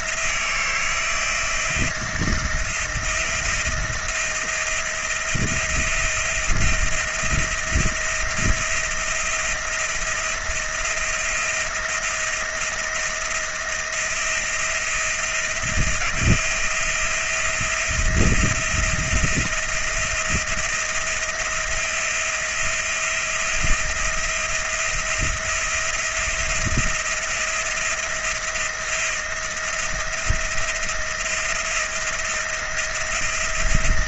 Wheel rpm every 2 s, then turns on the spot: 170, 170, 170, 170, 170, 170, 170, 170, 170, 170, 170, 170, 170, 170, 170, 160, 170.
none